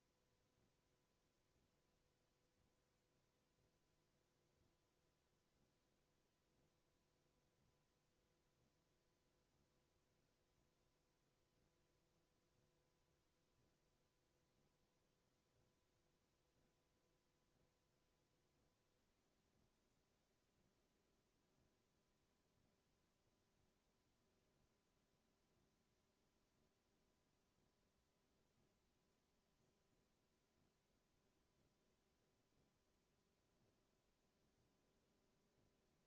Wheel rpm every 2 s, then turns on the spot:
0, 0, 0, 0, 0, 0, 0, 0, 0, 0, 0, 0, 0, 0, 0, 0, 0, 0.
none